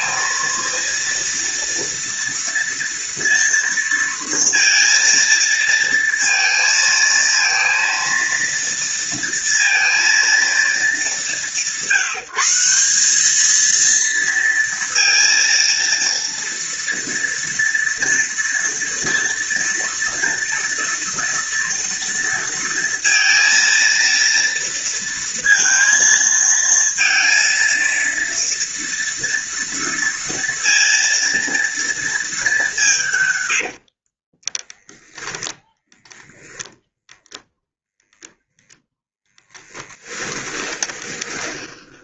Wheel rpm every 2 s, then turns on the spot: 230, 230, 230, 230, 230, 210, 180, 230, 230, 240, 230, 230, 230, 230, 230, 230, 190, 10, 0, 0, 20.
34-36 40-42